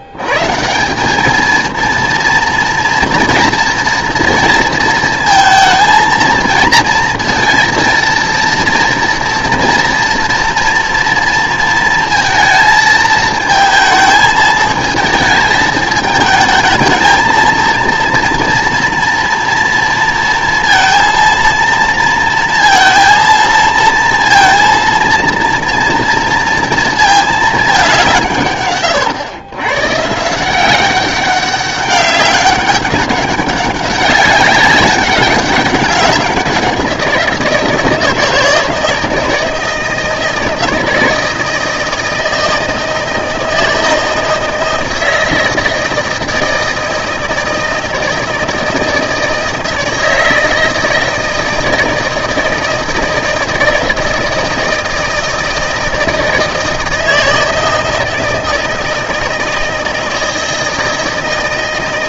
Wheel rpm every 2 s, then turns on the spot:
160, 240, 230, 230, 230, 230, 220, 220, 220, 230, 230, 230, 230, 230, 140, 180, 200, 200, 180, 160, 160, 160, 160, 160, 160, 160, 160, 160, 160, 160, 160.
none